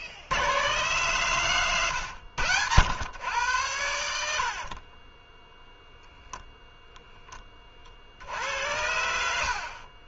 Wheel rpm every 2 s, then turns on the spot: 110, 80, 100, 0, 70.
4-6